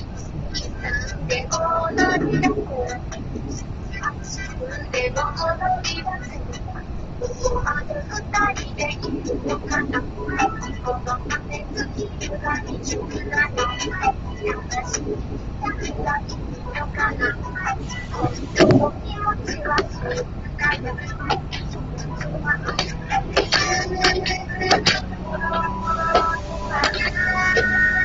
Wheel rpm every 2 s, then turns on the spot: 0, 0, 0, 0, 0, 0, 0, 0, 0, 0, 0, 0, 0, 0.
none